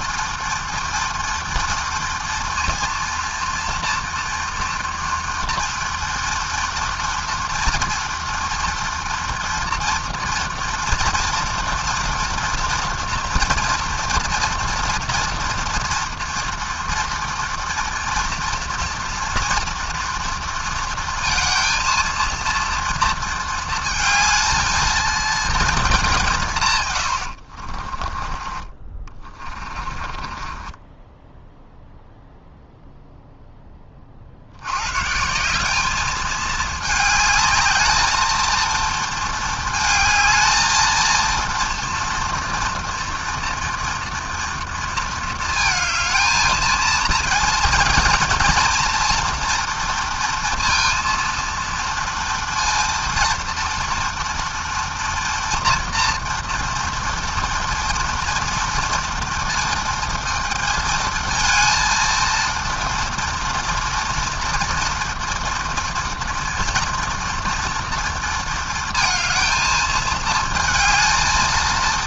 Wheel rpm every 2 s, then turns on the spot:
240, 230, 230, 230, 230, 230, 230, 230, 230, 230, 230, 230, 220, 80, 30, 10, 0, 180, 220, 220, 230, 240, 220, 230, 230, 230, 230, 230, 230, 230, 230, 230, 230, 230, 220, 230.
26-32